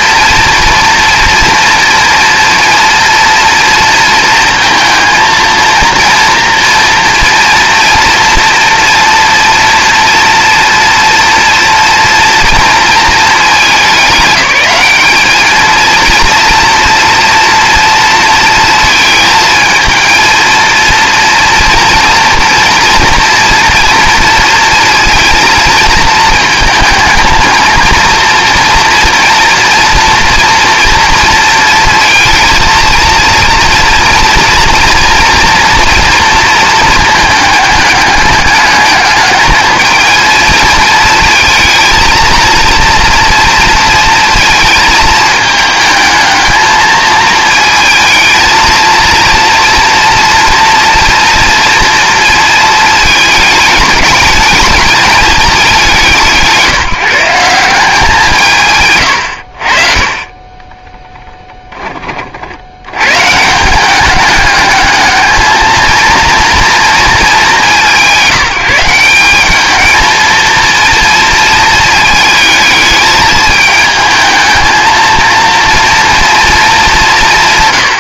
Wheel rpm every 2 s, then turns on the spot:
230, 230, 230, 230, 230, 230, 230, 200, 230, 220, 230, 230, 230, 220, 230, 240, 230, 230, 220, 210, 230, 230, 230, 220, 230, 240, 220, 220, 170, 130, 10, 90, 210, 230, 190, 230, 220, 230, 200.
60-62